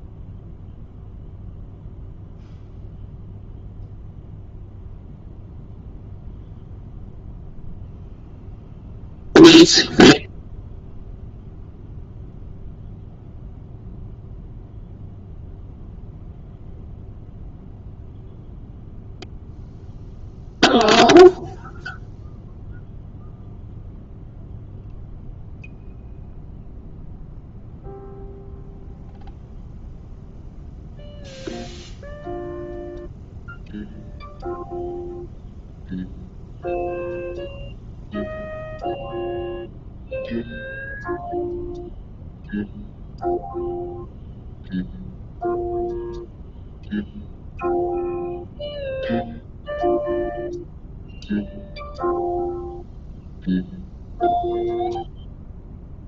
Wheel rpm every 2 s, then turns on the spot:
0, 0, 0, 0, 0, 0, 0, 0, 0, 0, 0, 0, 0, 0, 0, 0, 0, 0, 0, 0, 0, 0, 0, 0, 0, 0, 0, 0.
none